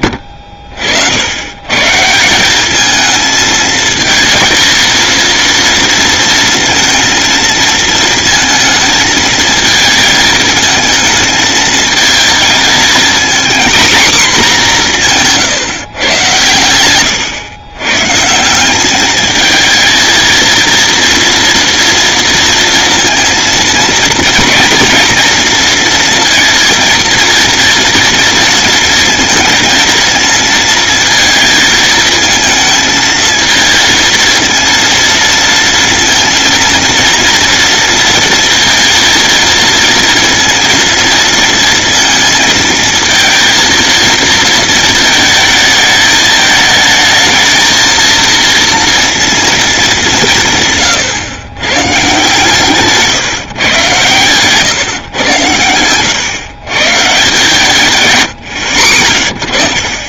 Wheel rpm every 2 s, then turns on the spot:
80, 220, 230, 230, 220, 220, 230, 170, 110, 210, 240, 230, 230, 230, 230, 230, 230, 230, 230, 230, 230, 230, 230, 220, 230, 130, 140, 120, 140, 80.
none